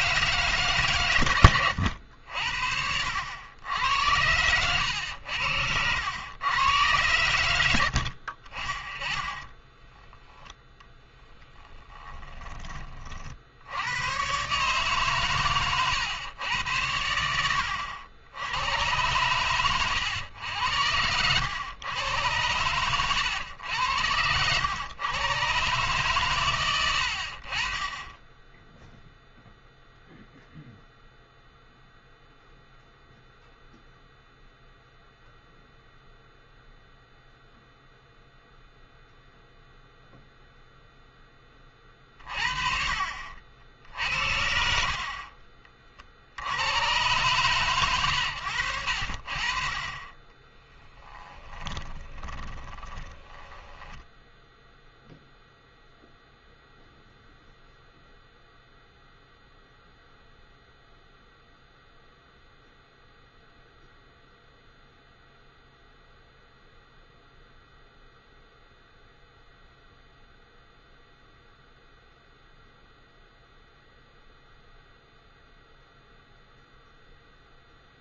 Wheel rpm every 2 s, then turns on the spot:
140, 70, 100, 110, 40, 10, 20, 140, 100, 90, 100, 110, 100, 100, 10, 0, 0, 0, 0, 0, 0, 40, 70, 80, 90, 10, 20, 0, 0, 0, 0, 0, 0, 0, 0, 0, 0, 0, 0.
22-24 50-54